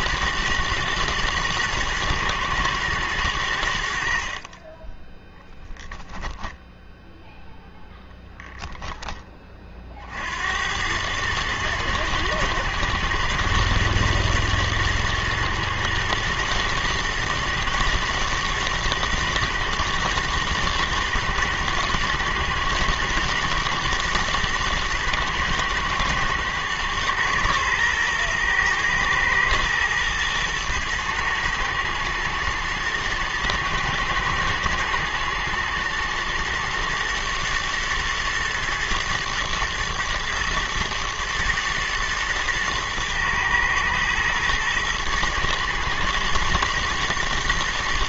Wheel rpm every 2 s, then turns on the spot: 110, 110, 20, 0, 10, 100, 110, 120, 120, 110, 110, 110, 110, 120, 120, 110, 110, 110, 120, 110, 110, 120, 110, 120.
none